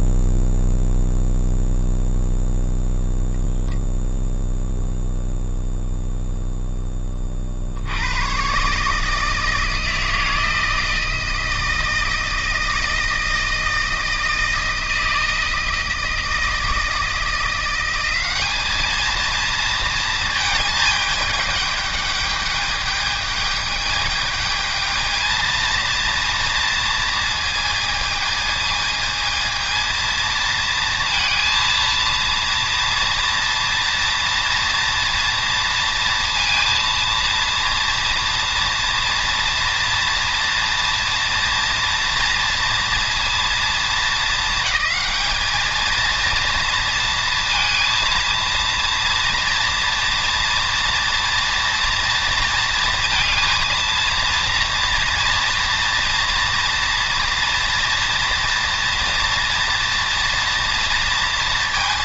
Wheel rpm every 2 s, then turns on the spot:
0, 0, 0, 20, 150, 160, 160, 160, 170, 220, 210, 210, 220, 230, 220, 230, 240, 230, 230, 240, 230, 230, 220, 230, 230, 240, 230, 230, 230, 240, 230.
none